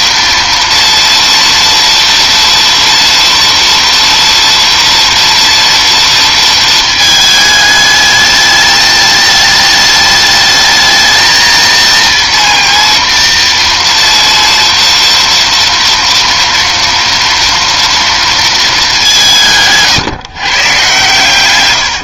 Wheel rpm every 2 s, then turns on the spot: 230, 230, 230, 230, 210, 210, 230, 230, 230, 230, 150.
none